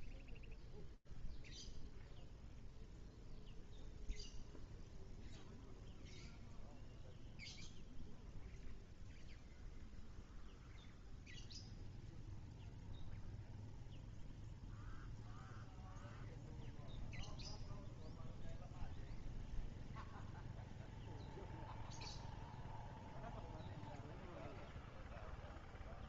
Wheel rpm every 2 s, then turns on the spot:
0, 0, 0, 0, 0, 0, 0, 0, 0, 0, 0, 0, 0.
none